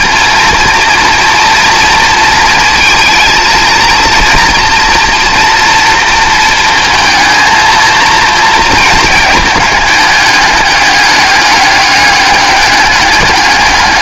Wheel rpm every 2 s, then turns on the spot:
230, 230, 230, 230, 230, 210, 200.
none